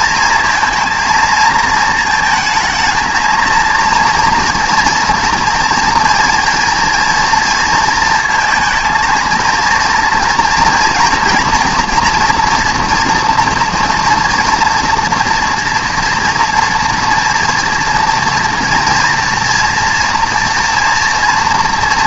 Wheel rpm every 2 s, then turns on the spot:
230, 220, 230, 230, 220, 230, 230, 230, 230, 240, 230.
none